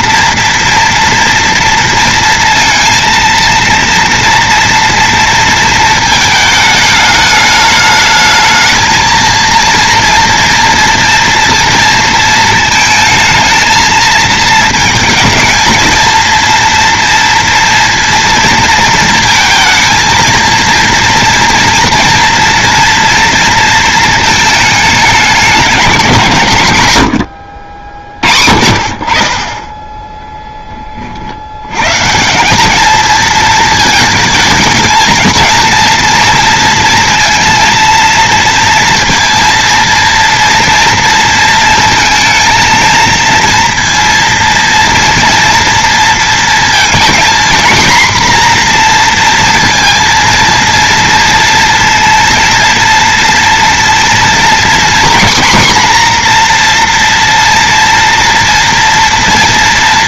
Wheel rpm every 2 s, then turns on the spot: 230, 230, 230, 220, 220, 240, 220, 220, 230, 230, 230, 230, 220, 100, 60, 10, 210, 220, 230, 230, 230, 230, 230, 230, 240, 230, 230, 250, 230, 230.
none